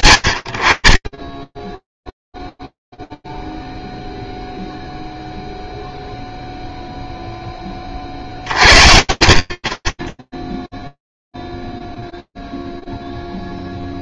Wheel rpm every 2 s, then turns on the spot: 60, 0, 0, 0, 70, 0, 0.
none